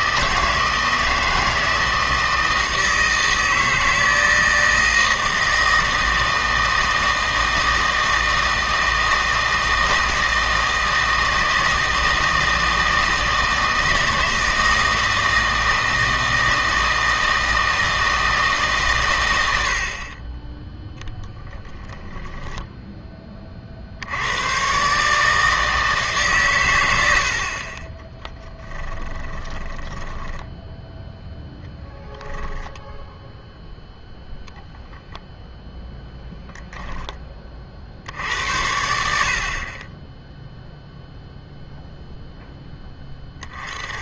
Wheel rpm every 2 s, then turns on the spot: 160, 160, 160, 160, 160, 160, 160, 160, 160, 140, 10, 10, 120, 100, 10, 10, 10, 0, 0, 80, 0, 10.
28-32